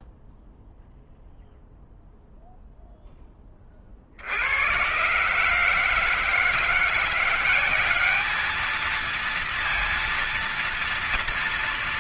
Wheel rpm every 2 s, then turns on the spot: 0, 0, 60, 150, 200, 230.
none